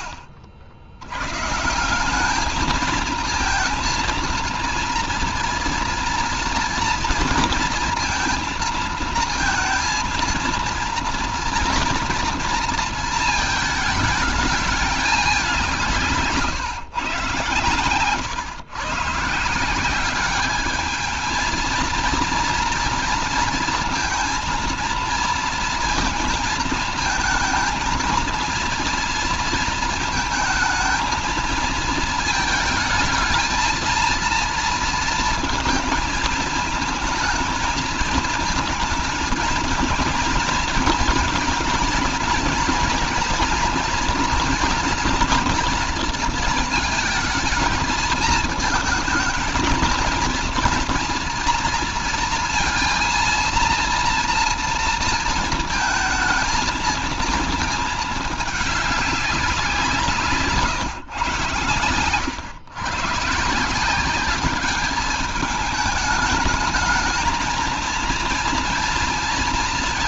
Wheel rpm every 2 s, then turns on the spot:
70, 220, 230, 230, 230, 230, 230, 210, 150, 130, 210, 230, 230, 230, 230, 220, 220, 230, 230, 230, 230, 230, 240, 230, 220, 230, 230, 230, 230, 200, 140, 120, 200, 220, 230.
none